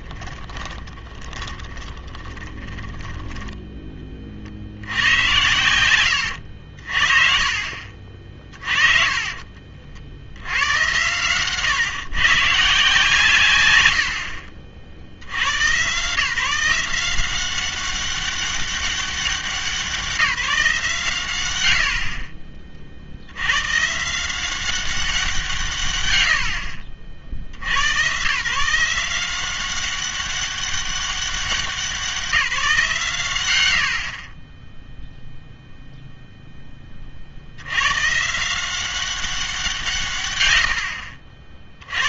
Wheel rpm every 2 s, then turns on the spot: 20, 20, 70, 70, 40, 100, 150, 70, 160, 200, 160, 40, 190, 70, 150, 200, 150, 10, 10, 170, 80.
0-4